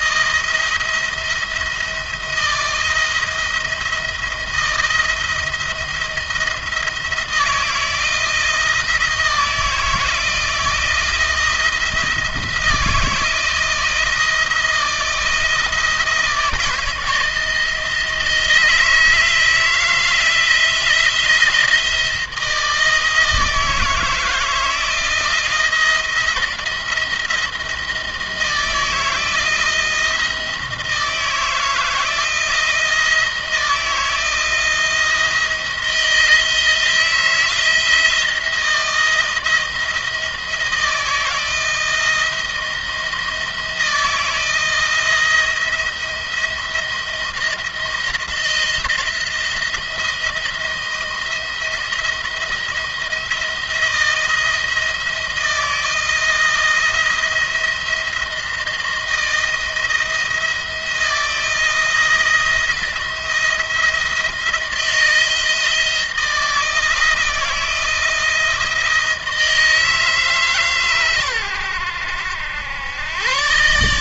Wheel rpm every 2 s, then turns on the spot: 170, 170, 170, 170, 170, 160, 170, 170, 170, 160, 160, 160, 160, 170, 160, 160, 170, 170, 160, 170, 160, 170, 170, 170, 170, 170, 170, 160, 170, 160, 170, 170, 170, 170, 160, 140, 90.
none